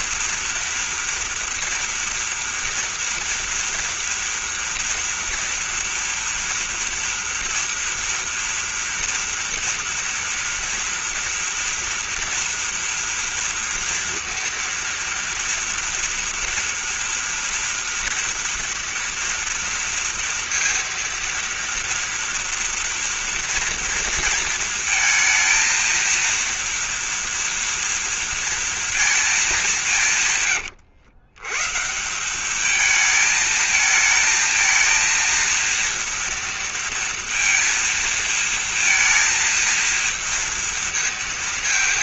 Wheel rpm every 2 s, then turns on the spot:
230, 230, 230, 230, 230, 240, 230, 230, 240, 230, 230, 230, 230, 230, 230, 140, 200, 230, 230, 230, 230.
none